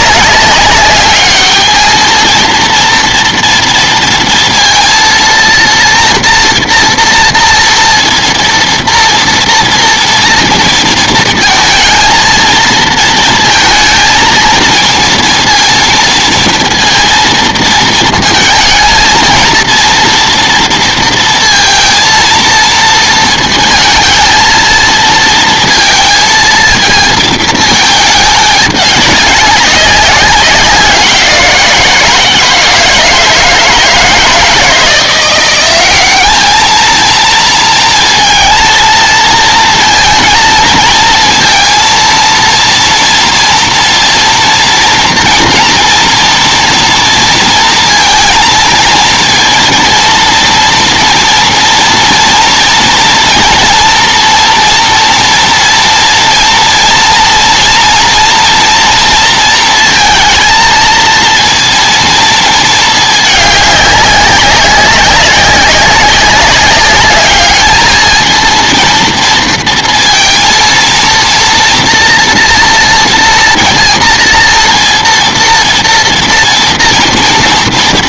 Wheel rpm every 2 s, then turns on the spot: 200, 230, 230, 230, 230, 230, 230, 230, 230, 230, 230, 230, 230, 220, 210, 180, 160, 160, 220, 230, 230, 230, 230, 230, 220, 230, 230, 230, 230, 230, 230, 220, 190, 200, 230, 230, 230, 230, 230.
none